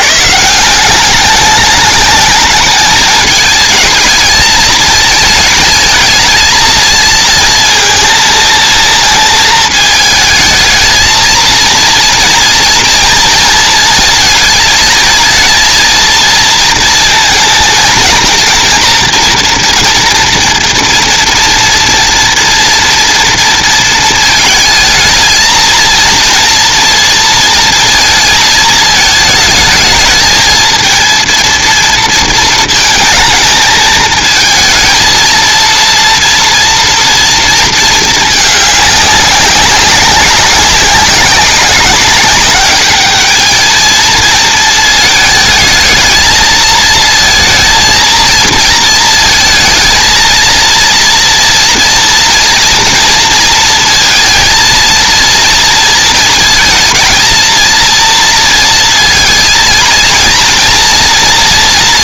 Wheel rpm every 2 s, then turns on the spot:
210, 210, 230, 230, 220, 230, 230, 230, 230, 230, 230, 230, 230, 230, 220, 240, 220, 230, 230, 190, 190, 220, 220, 230, 230, 230, 230, 230, 230, 230, 230.
none